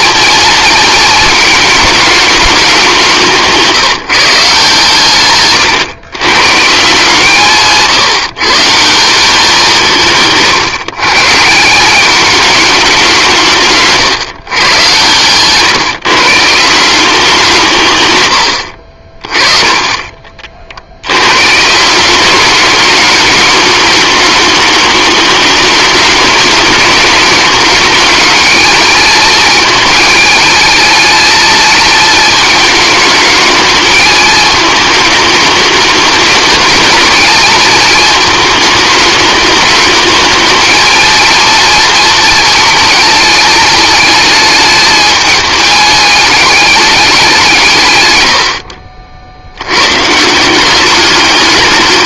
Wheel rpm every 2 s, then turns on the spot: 230, 190, 140, 150, 170, 140, 200, 120, 180, 60, 70, 210, 210, 210, 220, 220, 210, 220, 220, 210, 220, 220, 220, 200, 60, 190.
18-20